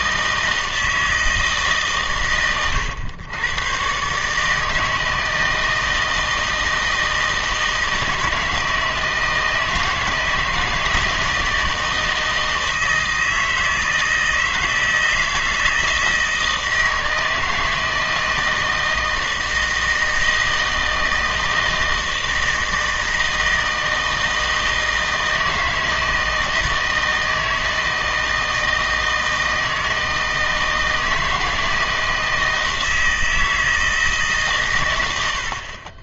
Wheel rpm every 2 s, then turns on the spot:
160, 110, 160, 160, 160, 160, 160, 160, 160, 160, 160, 160, 160, 160, 160, 160, 160, 140.
none